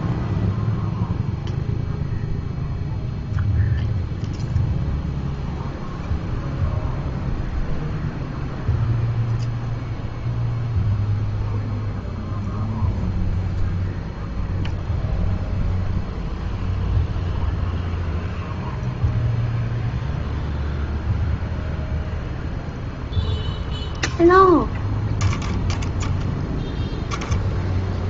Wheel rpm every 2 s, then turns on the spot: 0, 0, 0, 0, 0, 0, 0, 0, 0, 0, 0, 0, 10, 10.
none